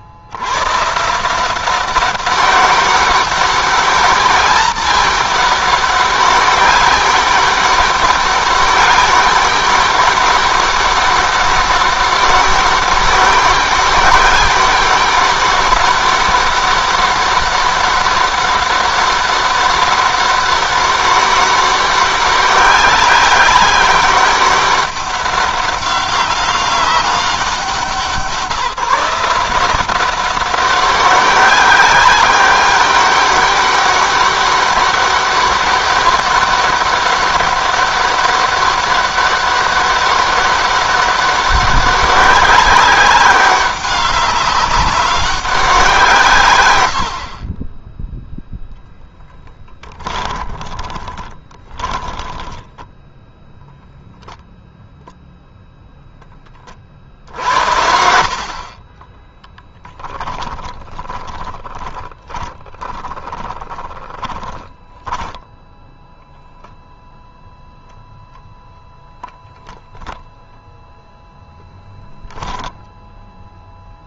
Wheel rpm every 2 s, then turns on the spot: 140, 190, 200, 200, 200, 200, 200, 200, 200, 200, 200, 190, 200, 190, 170, 190, 200, 200, 200, 200, 200, 200, 190, 80, 10, 20, 0, 0, 60, 30, 20, 20, 20, 0, 0, 0, 0.
50-52 56-66